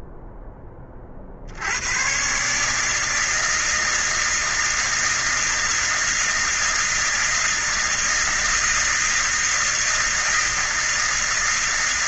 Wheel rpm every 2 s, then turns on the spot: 10, 140, 160, 160, 160, 160.
none